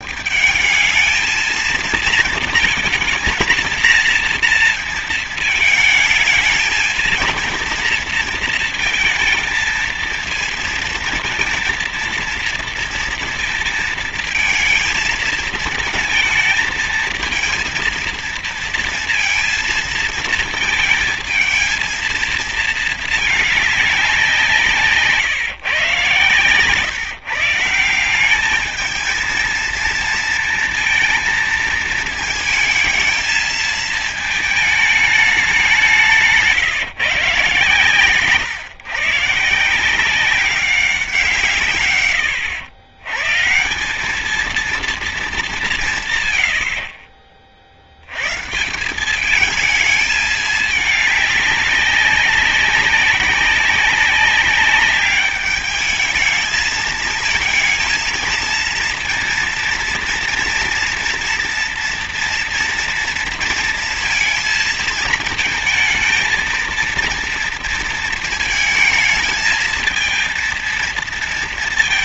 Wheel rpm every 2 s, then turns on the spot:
210, 230, 220, 220, 220, 230, 230, 230, 220, 230, 230, 220, 160, 140, 210, 220, 220, 210, 150, 120, 190, 100, 220, 100, 150, 210, 200, 200, 220, 230, 240, 230, 230, 230, 220, 230.
none